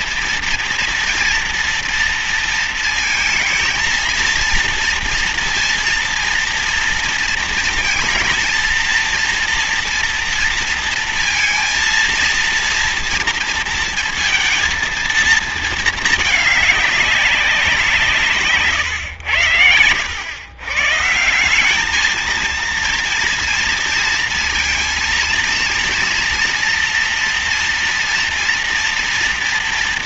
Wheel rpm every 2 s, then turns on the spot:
230, 230, 230, 230, 230, 230, 230, 230, 210, 130, 140, 230, 230, 230, 230.
none